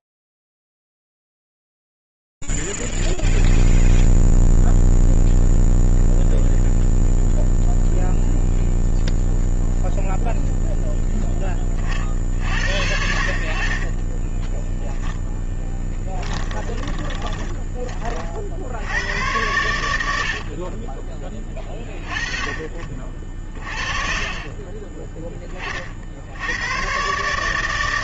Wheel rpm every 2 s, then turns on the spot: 10, 0, 0, 10, 0, 0, 60, 20, 10, 30, 70, 30, 30, 110.
0-2 14-18